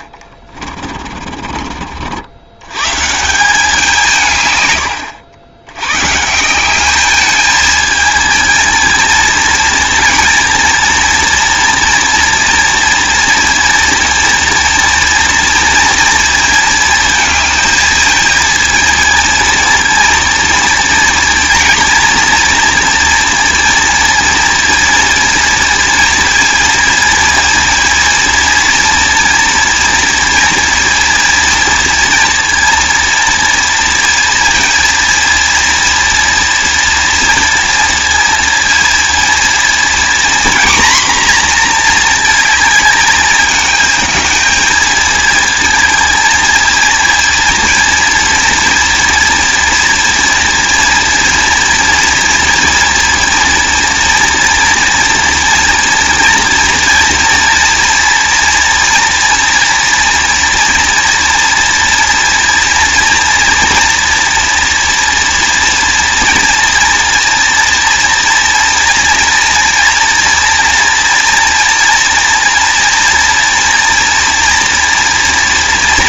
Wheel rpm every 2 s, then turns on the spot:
40, 110, 110, 190, 220, 230, 230, 230, 230, 230, 230, 230, 230, 230, 230, 230, 230, 230, 230, 230, 240, 220, 220, 230, 230, 230, 230, 240, 230, 230, 230, 230, 230, 230, 230, 230, 230, 230.
0-2